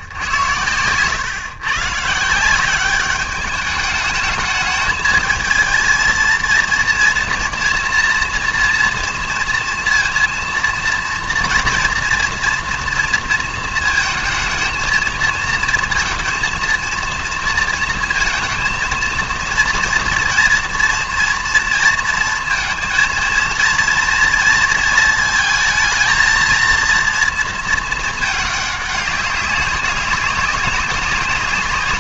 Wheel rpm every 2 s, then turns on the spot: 100, 180, 210, 230, 230, 230, 230, 220, 230, 230, 230, 230, 230, 230, 210, 200.
none